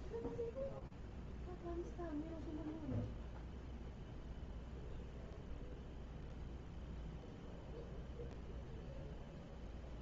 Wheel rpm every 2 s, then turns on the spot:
0, 0, 0, 0, 0.
none